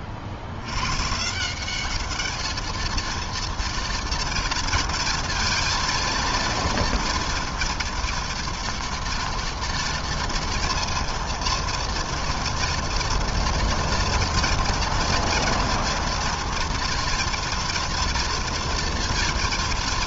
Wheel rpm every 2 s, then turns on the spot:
170, 230, 230, 230, 230, 230, 230, 230, 230, 230.
none